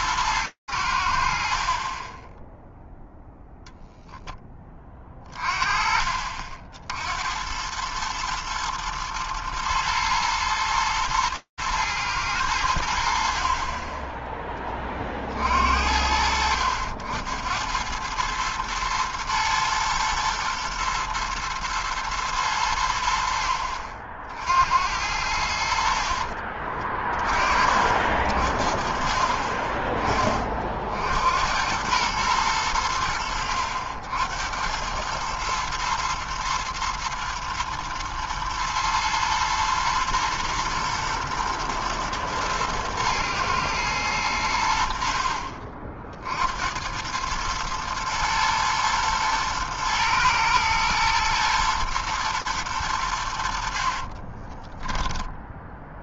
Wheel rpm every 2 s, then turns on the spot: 100, 10, 10, 40, 110, 110, 90, 10, 80, 110, 120, 110, 60, 50, 50, 30, 110, 90, 110, 110, 120, 110, 90, 60, 110, 110, 110, 20.
26-28 54-56